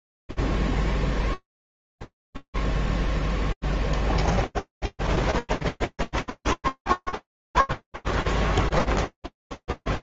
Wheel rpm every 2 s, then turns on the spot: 0, 0, 0, 0, 0.
none